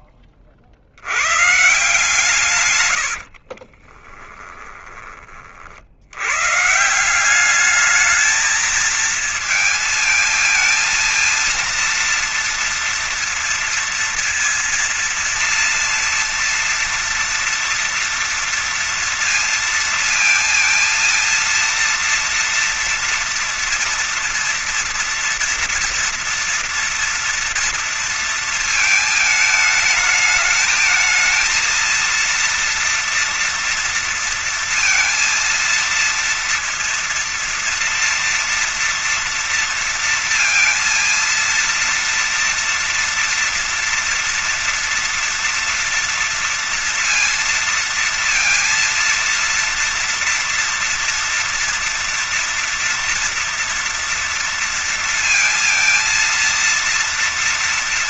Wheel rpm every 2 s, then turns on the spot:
50, 110, 20, 150, 220, 220, 230, 230, 230, 230, 230, 230, 230, 240, 230, 220, 230, 230, 230, 230, 230, 230, 230, 230, 230, 230, 230, 230, 230.
2-4